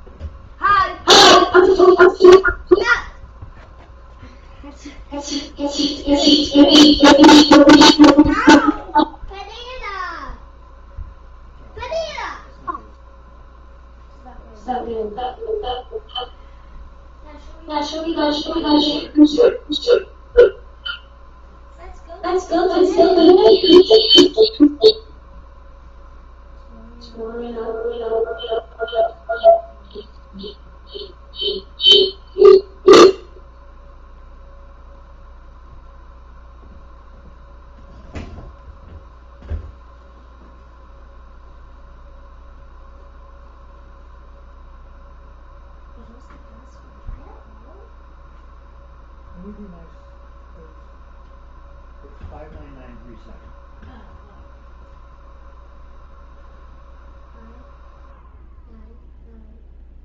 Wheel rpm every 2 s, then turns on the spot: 0, 0, 0, 0, 0, 0, 0, 0, 0, 0, 0, 0, 0, 0, 0, 0, 0, 0, 0, 0, 0, 0, 0, 0, 0, 0, 0, 0, 0, 0.
none